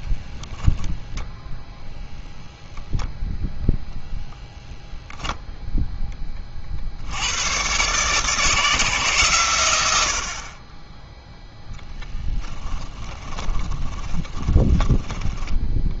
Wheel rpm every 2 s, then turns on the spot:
0, 0, 0, 50, 150, 30, 10, 20.
12-16